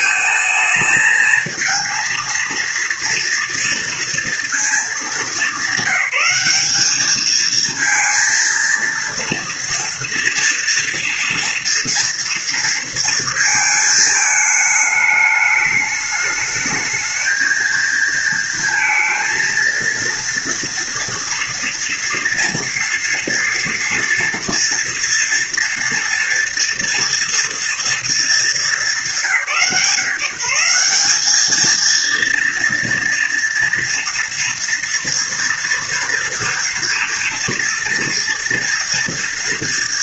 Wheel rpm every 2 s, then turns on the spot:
220, 230, 220, 200, 230, 230, 230, 220, 220, 230, 240, 230, 230, 230, 210, 180, 230, 230, 230, 230.
none